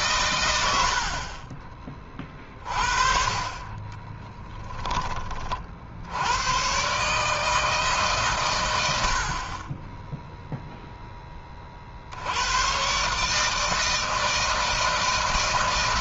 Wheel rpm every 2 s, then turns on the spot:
80, 50, 20, 120, 110, 0, 110, 160.
4-6